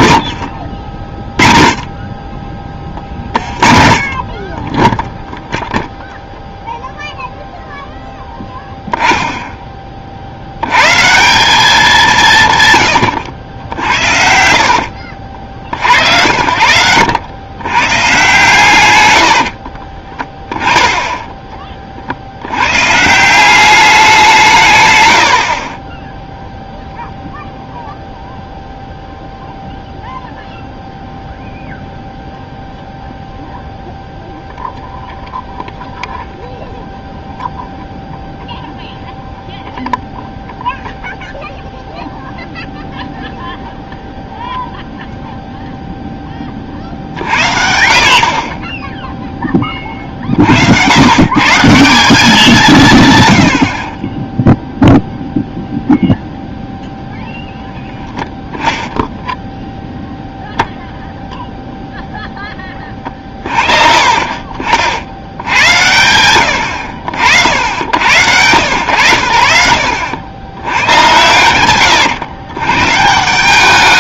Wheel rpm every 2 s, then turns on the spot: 100, 30, 20, 0, 10, 100, 130, 60, 80, 120, 20, 110, 150, 0, 0, 0, 0, 0, 0, 0, 0, 0, 0, 50, 30, 80, 160, 0, 0, 0, 0, 20, 50, 90, 100, 110, 130.
0-2 14-16 20-22 62-66